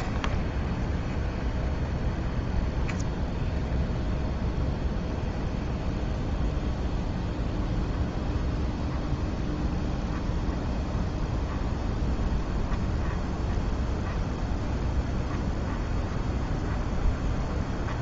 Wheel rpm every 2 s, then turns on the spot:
10, 20, 20, 20, 20, 20, 20, 20, 20.
0-18